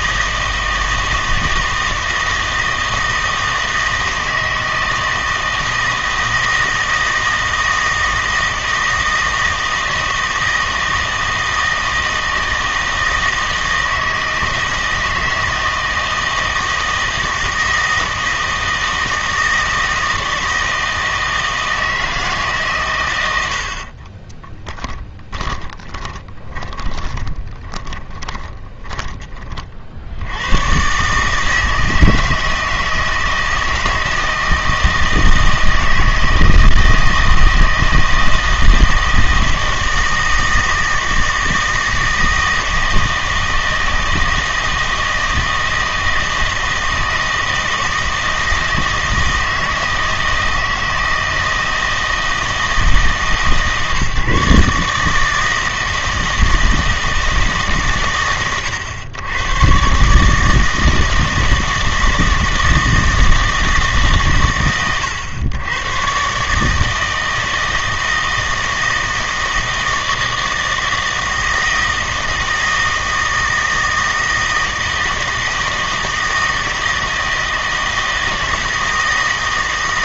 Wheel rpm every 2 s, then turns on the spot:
160, 160, 160, 160, 160, 160, 160, 160, 160, 160, 160, 130, 20, 20, 20, 110, 160, 160, 160, 160, 160, 160, 160, 160, 160, 160, 160, 150, 160, 120, 160, 160, 120, 150, 160, 160, 160, 160, 170, 160.
24-30